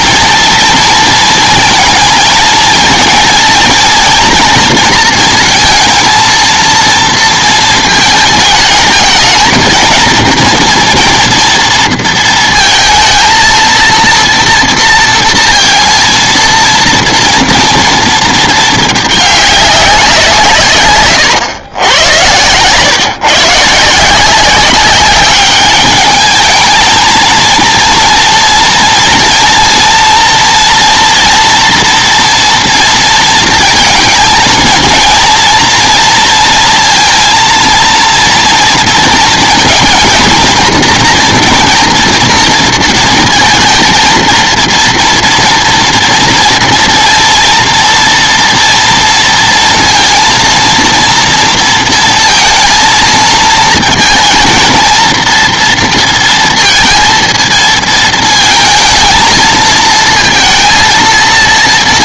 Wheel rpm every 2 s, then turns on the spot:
230, 220, 230, 230, 220, 230, 230, 230, 230, 210, 140, 130, 190, 220, 230, 230, 230, 230, 230, 230, 230, 230, 230, 230, 230, 230, 230, 230, 230, 220, 220.
none